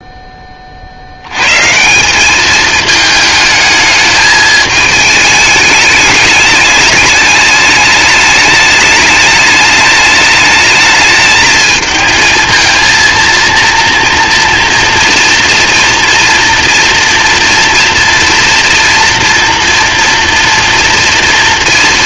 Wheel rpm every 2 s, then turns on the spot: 70, 210, 220, 210, 210, 210, 230, 230, 230, 230, 230.
none